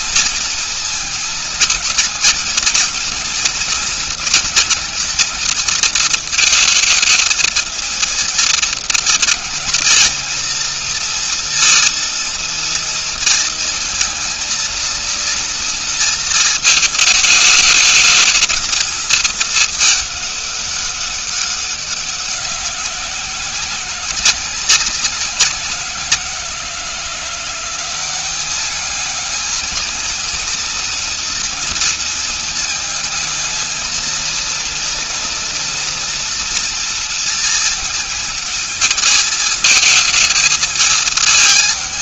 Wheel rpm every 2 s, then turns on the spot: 230, 220, 220, 220, 230, 230, 230, 230, 220, 220, 210, 190, 180, 180, 200, 230, 230, 230, 230, 220, 220.
none